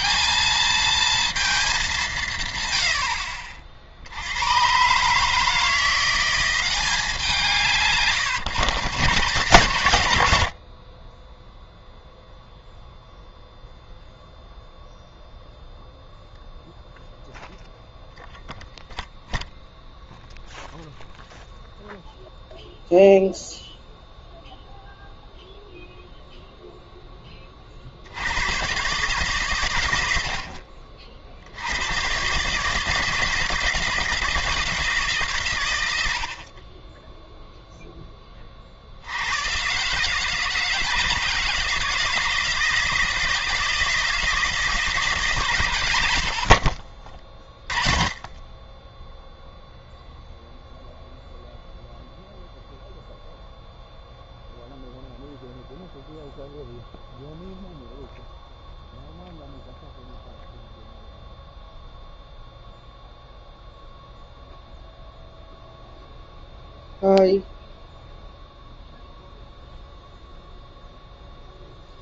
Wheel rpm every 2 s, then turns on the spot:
220, 120, 120, 190, 140, 60, 0, 0, 0, 0, 0, 0, 0, 0, 120, 50, 150, 160, 30, 60, 160, 160, 160, 50, 10, 0, 0, 0, 0, 0, 0, 0, 0, 0, 0, 0.
none